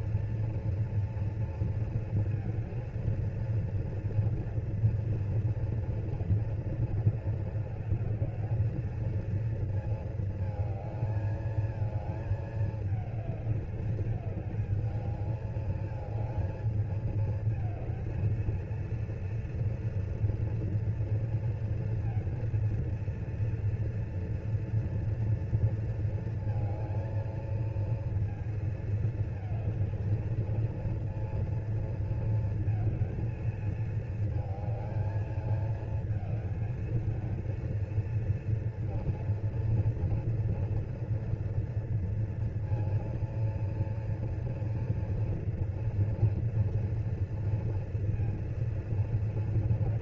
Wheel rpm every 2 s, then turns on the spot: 240, 220, 230, 230, 220, 220, 220, 210, 220, 230, 240, 230, 230, 230, 230, 230, 230, 220, 220, 230, 230, 230, 230, 230, 230.
none